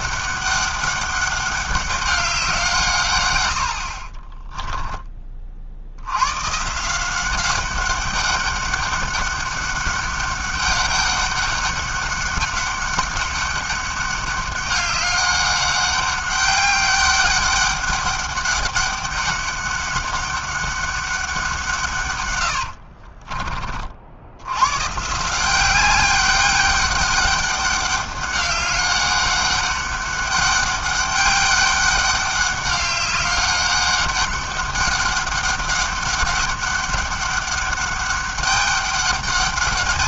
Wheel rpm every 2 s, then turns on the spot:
200, 160, 10, 160, 200, 200, 200, 200, 200, 200, 200, 70, 130, 200, 200, 200, 200, 190, 190, 200.
4-6 22-24